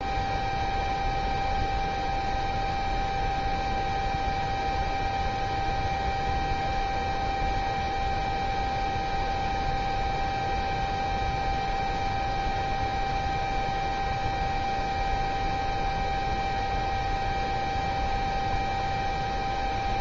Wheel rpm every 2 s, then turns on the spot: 0, 0, 0, 0, 0, 0, 0, 0, 0, 0.
none